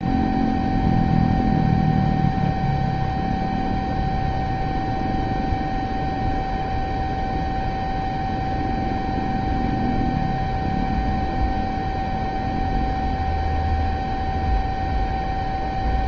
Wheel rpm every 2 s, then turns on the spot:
0, 0, 0, 0, 0, 0, 0, 0.
none